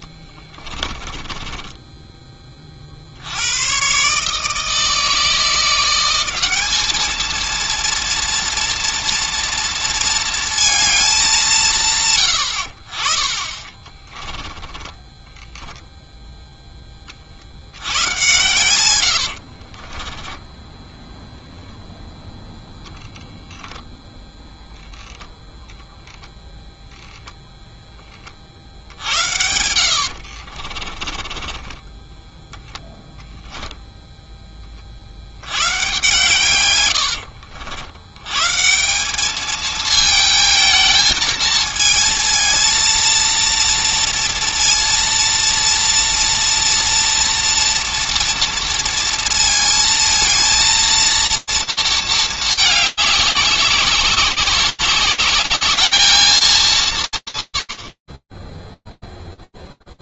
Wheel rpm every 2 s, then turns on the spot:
10, 30, 160, 200, 230, 220, 90, 10, 30, 90, 0, 0, 0, 0, 60, 40, 10, 30, 110, 160, 220, 230, 230, 230, 230, 220, 210, 190, 210, 20.
0-2 14-16 18-20 30-32